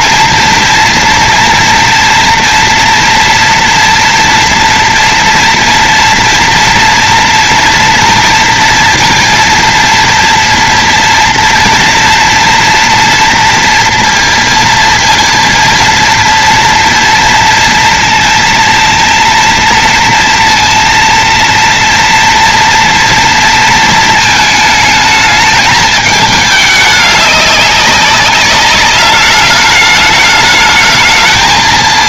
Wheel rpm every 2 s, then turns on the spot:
230, 230, 230, 230, 230, 230, 230, 230, 240, 230, 230, 230, 220, 210, 200, 210.
none